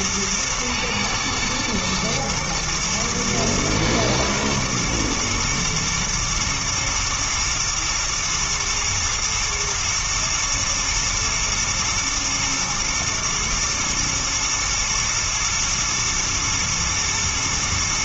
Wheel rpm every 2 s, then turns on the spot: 110, 120, 110, 120, 110, 110, 110, 110, 120.
none